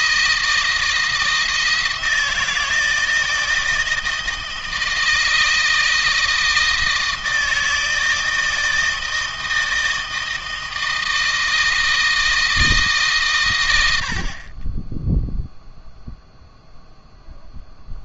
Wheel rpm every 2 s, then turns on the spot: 160, 160, 160, 160, 160, 160, 160, 20, 0.
none